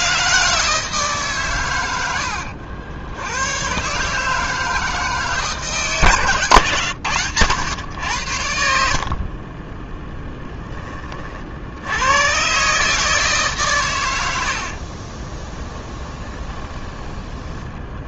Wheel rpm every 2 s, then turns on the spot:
160, 80, 160, 120, 50, 20, 150, 50, 10.
8-10 14-18